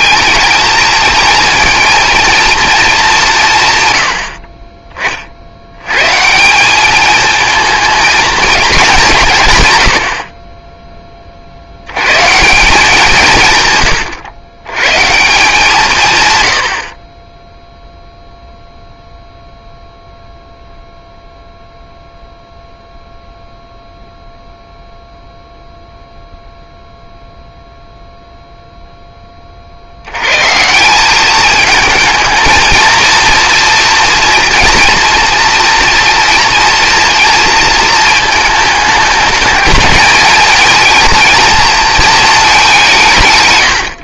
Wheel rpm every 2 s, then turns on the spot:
230, 220, 20, 200, 210, 20, 170, 130, 50, 0, 0, 0, 0, 0, 0, 170, 230, 230, 230, 220, 220, 180.
none